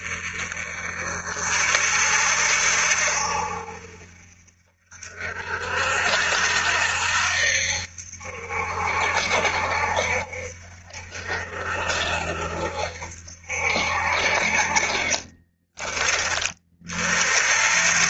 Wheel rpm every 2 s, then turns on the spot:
40, 60, 50, 70, 70, 60, 60, 40, 40.
14-16